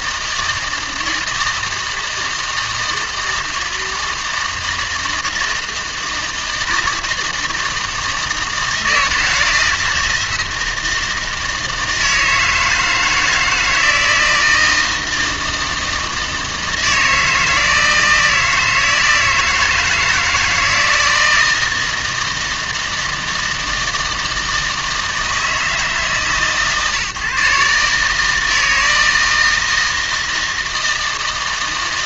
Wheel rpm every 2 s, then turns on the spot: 160, 160, 160, 160, 160, 160, 160, 160, 160, 160, 160, 160, 160, 140, 160, 160.
none